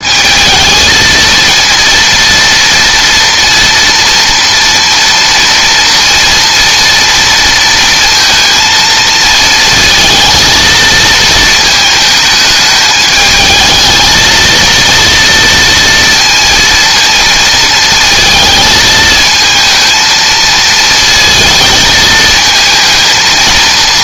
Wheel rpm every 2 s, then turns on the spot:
220, 230, 230, 230, 230, 220, 210, 230, 230, 220, 220, 230.
none